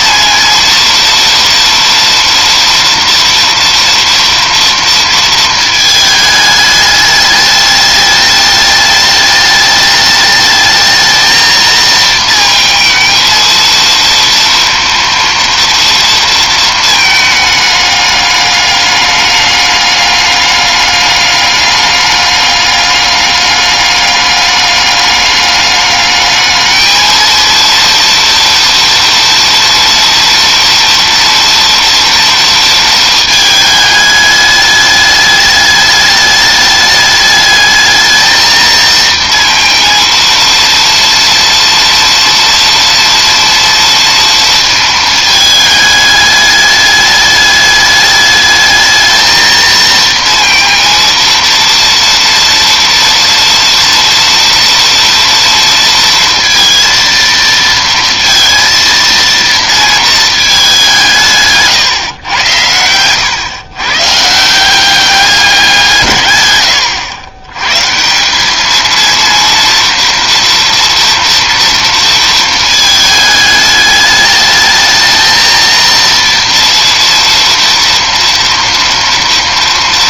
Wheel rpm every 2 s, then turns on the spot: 230, 230, 230, 220, 210, 210, 220, 230, 230, 210, 200, 200, 200, 210, 230, 230, 230, 210, 210, 220, 230, 230, 230, 210, 210, 230, 230, 230, 230, 230, 220, 120, 150, 140, 180, 230, 220, 210, 230, 230.
none